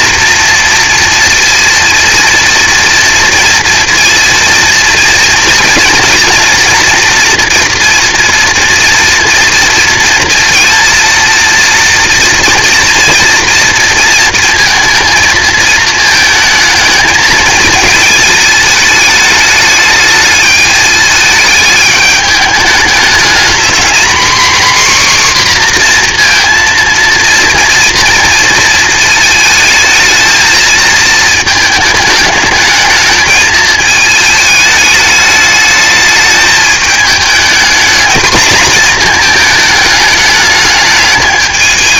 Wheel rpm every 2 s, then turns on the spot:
240, 230, 230, 230, 230, 230, 230, 230, 220, 210, 210, 210, 260, 230, 230, 220, 220, 220, 220, 230, 210.
none